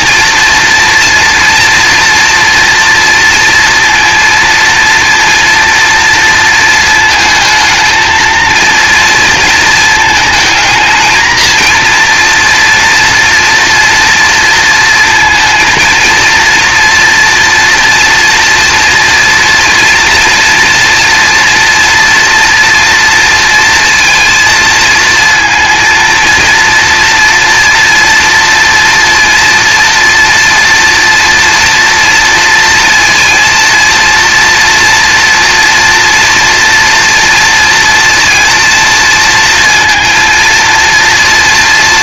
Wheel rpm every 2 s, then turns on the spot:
230, 230, 230, 220, 230, 220, 240, 230, 230, 230, 230, 230, 230, 230, 230, 240, 230, 230, 230, 230, 230.
none